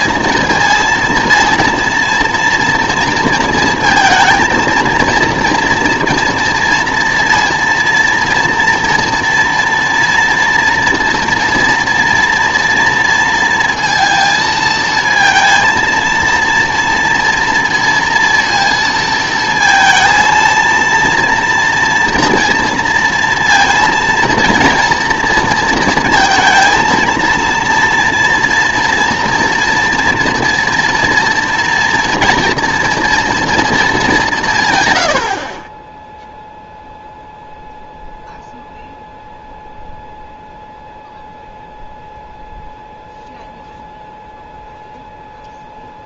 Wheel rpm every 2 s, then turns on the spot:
230, 230, 230, 230, 230, 240, 230, 220, 230, 230, 230, 230, 230, 230, 230, 230, 230, 140, 0, 0, 0, 0, 0.
none